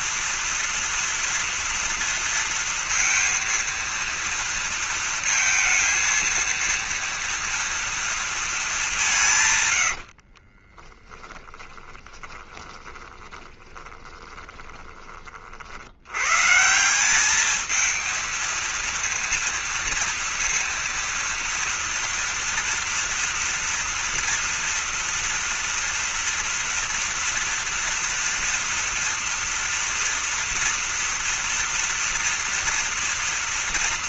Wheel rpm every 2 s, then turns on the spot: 230, 230, 230, 230, 220, 30, 20, 20, 140, 230, 230, 230, 230, 240, 230, 230, 230.
10-16